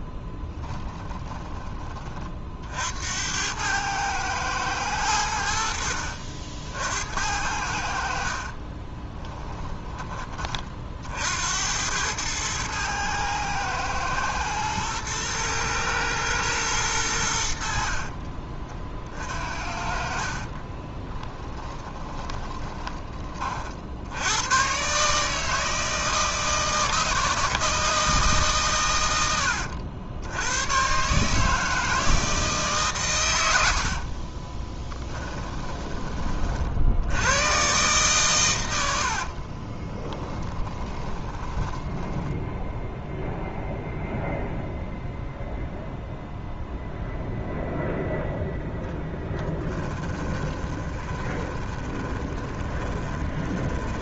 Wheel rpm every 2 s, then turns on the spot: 20, 60, 100, 60, 30, 50, 110, 110, 110, 40, 30, 20, 130, 160, 120, 120, 140, 10, 60, 80, 20, 0, 0, 0, 10, 20, 20.
0-2 8-10 20-22 34-36 40-42 48-54